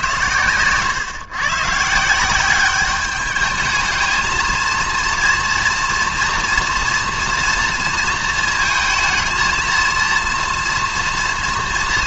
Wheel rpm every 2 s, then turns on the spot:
120, 190, 230, 230, 230, 230.
none